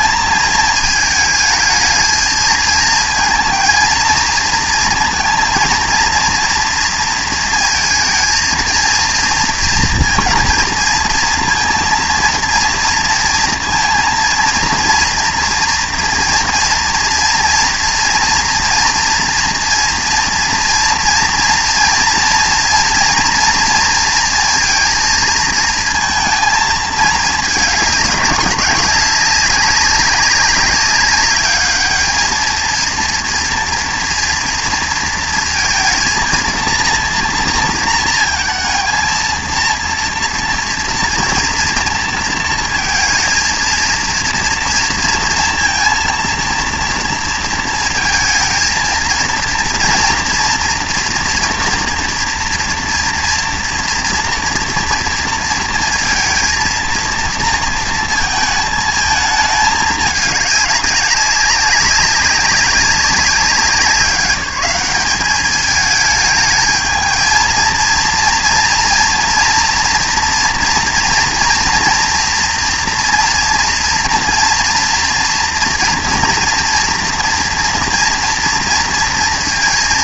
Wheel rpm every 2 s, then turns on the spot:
220, 220, 230, 230, 230, 230, 230, 230, 230, 230, 230, 230, 230, 220, 200, 200, 230, 230, 230, 230, 230, 230, 230, 230, 220, 230, 240, 230, 230, 220, 200, 200, 200, 220, 230, 240, 230, 230, 230, 230.
none